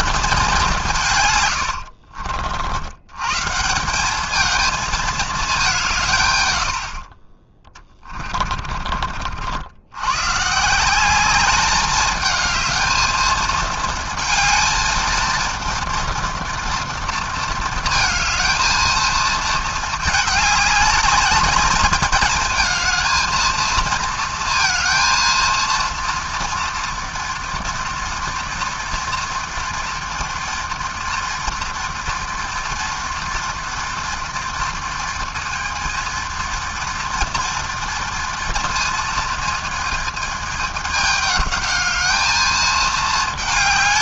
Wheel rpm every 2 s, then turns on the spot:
210, 70, 220, 100, 30, 150, 220, 230, 230, 220, 210, 220, 230, 230, 240, 230, 230, 230, 230, 230, 210, 220.
8-10